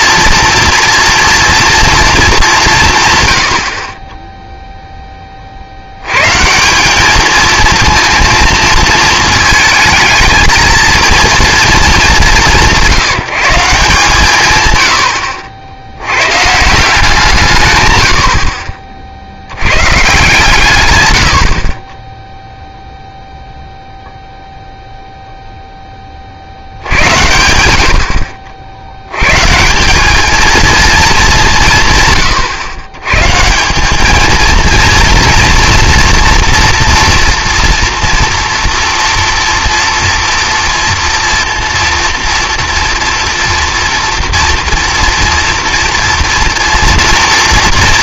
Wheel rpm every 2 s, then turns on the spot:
230, 190, 0, 160, 230, 220, 180, 130, 160, 40, 130, 0, 0, 70, 80, 230, 120, 230, 230, 230, 230, 230, 230, 240.
none